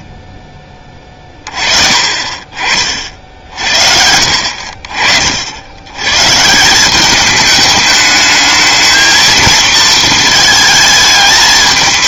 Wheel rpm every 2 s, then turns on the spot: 10, 40, 60, 160, 220, 220.
4-6